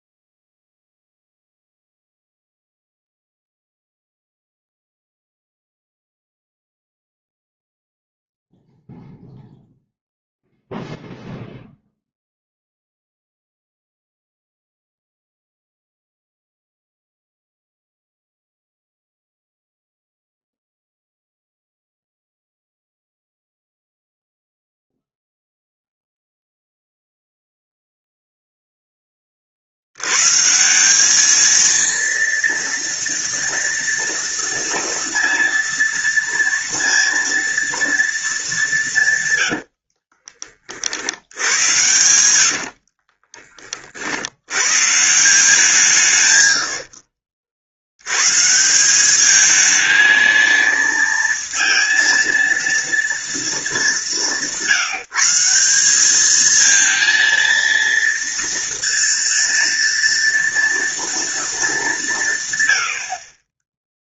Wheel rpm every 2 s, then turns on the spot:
0, 0, 0, 0, 0, 0, 0, 0, 0, 0, 0, 0, 0, 0, 10, 180, 230, 230, 230, 170, 50, 60, 140, 60, 180, 230, 230, 170, 230, 230, 230, 90.
42-44